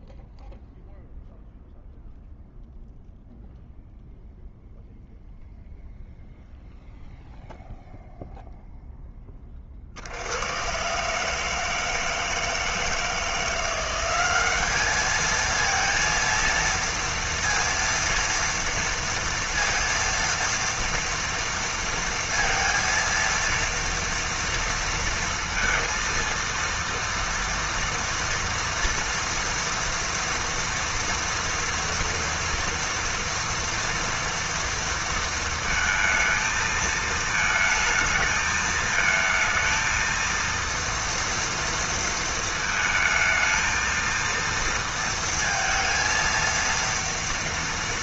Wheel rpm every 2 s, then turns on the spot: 0, 0, 0, 0, 0, 110, 160, 210, 230, 230, 230, 230, 230, 230, 230, 240, 230, 230, 220, 220, 230, 220, 230, 230.
none